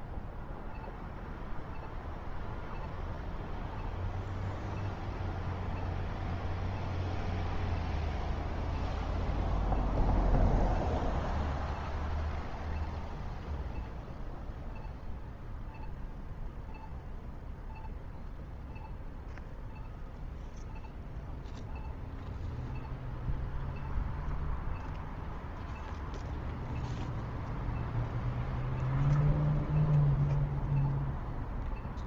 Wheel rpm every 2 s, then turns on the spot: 0, 0, 0, 0, 0, 0, 0, 0, 0, 0, 0, 0, 0, 0, 0, 0.
none